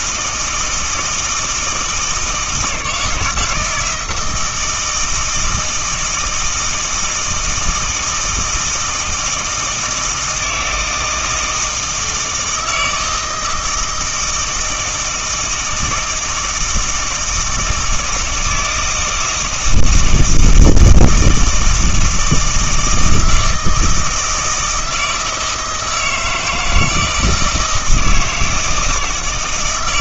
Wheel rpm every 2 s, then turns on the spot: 160, 160, 160, 160, 160, 160, 160, 170, 160, 160, 160, 160, 160, 160, 160.
none